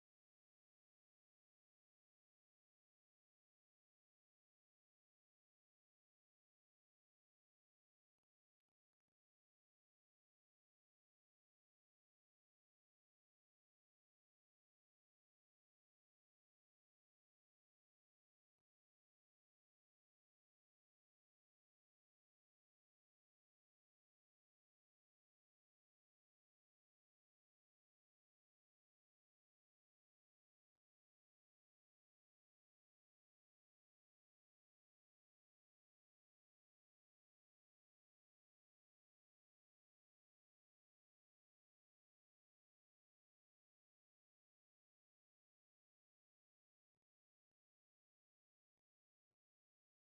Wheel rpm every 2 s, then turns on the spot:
0, 0, 0, 0, 0, 0, 0, 0, 0, 0, 0, 0, 0, 0, 0, 0, 0, 0, 0, 0, 0, 0, 0, 0, 0.
none